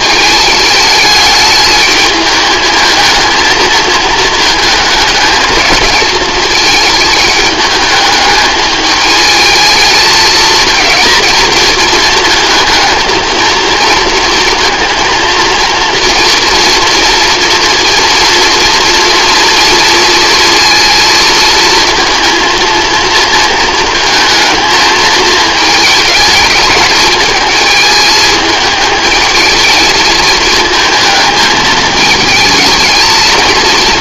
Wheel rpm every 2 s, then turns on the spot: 210, 220, 220, 220, 210, 230, 220, 230, 230, 230, 230, 230, 220, 220, 220, 220, 210.
none